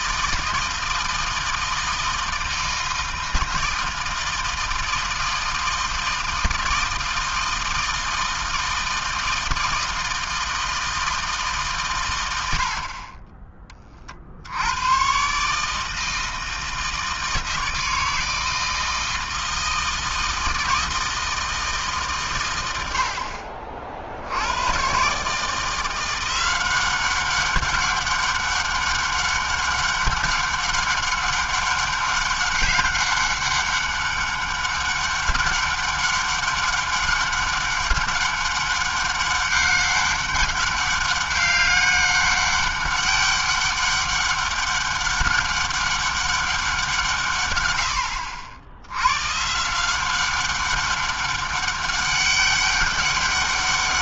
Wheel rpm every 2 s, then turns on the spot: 160, 160, 160, 160, 160, 160, 30, 120, 160, 160, 160, 70, 140, 190, 200, 200, 190, 200, 200, 200, 200, 200, 200, 150, 110, 200, 200.
none